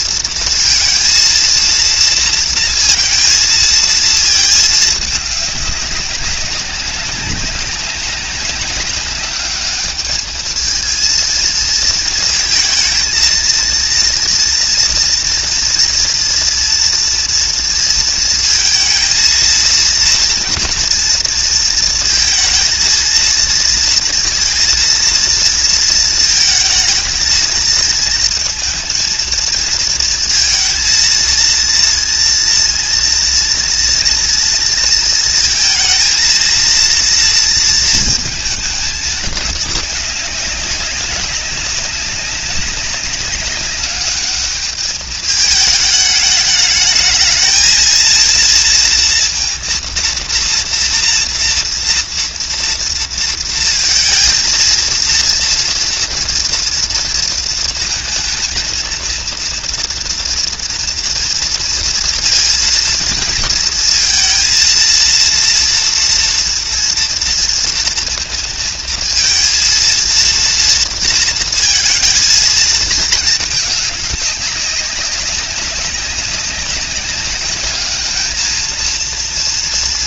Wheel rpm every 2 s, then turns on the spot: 230, 230, 220, 190, 200, 220, 230, 230, 230, 230, 230, 230, 230, 220, 220, 230, 230, 230, 230, 220, 200, 200, 210, 210, 230, 230, 230, 230, 230, 230, 230, 230, 230, 230, 230, 230, 220, 200, 190, 220.
none